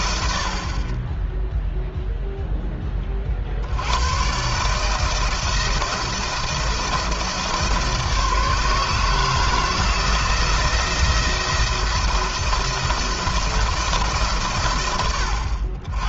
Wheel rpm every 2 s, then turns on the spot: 70, 0, 130, 170, 150, 170, 170, 130.
none